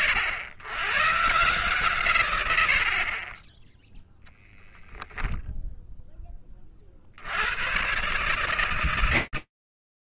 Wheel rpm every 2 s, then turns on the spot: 100, 80, 0, 10, 150.
none